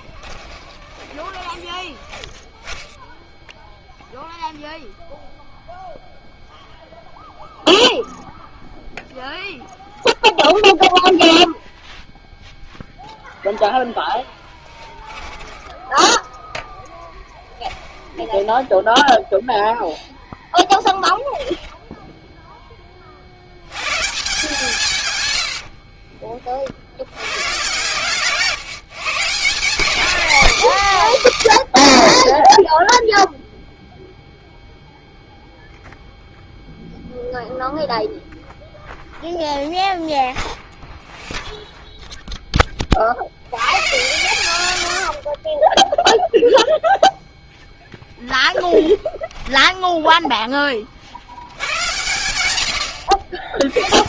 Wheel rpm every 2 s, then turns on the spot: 20, 0, 0, 0, 0, 0, 0, 10, 0, 10, 10, 10, 160, 50, 150, 250, 20, 0, 0, 0, 0, 10, 100, 0, 10, 20, 80.
0-2 14-16 18-20 48-50 52-54